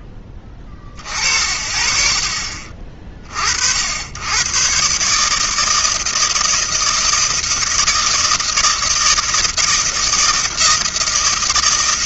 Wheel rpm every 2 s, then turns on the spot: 40, 50, 150, 160, 160, 160.
none